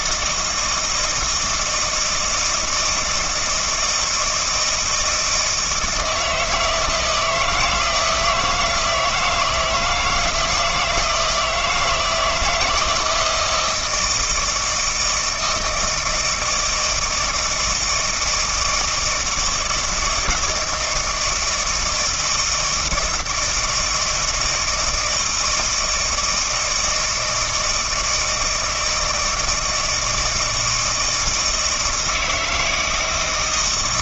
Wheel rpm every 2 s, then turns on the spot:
160, 160, 160, 170, 160, 160, 170, 160, 160, 160, 160, 160, 160, 160, 160, 160, 160.
none